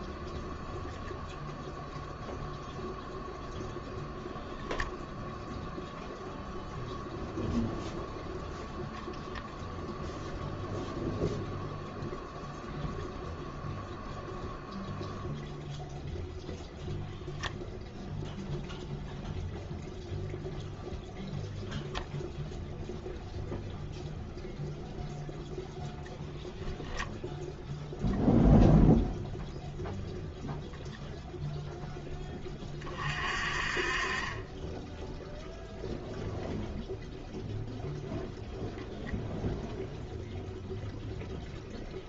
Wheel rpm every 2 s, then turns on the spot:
0, 0, 0, 0, 0, 0, 0, 0, 0, 0, 0, 0, 0, 0, 0, 0, 30, 10, 0, 0, 0.
none